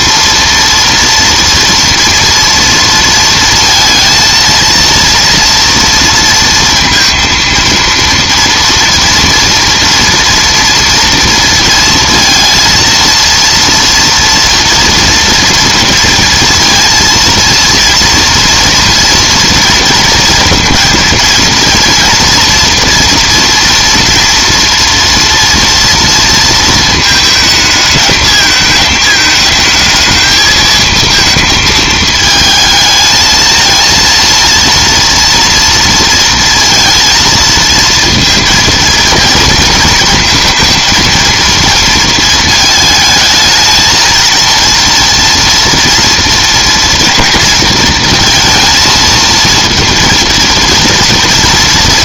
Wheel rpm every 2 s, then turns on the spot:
230, 230, 230, 230, 230, 230, 230, 230, 230, 230, 230, 240, 230, 230, 220, 220, 220, 230, 230, 230, 230, 220, 230, 230, 230, 240.
none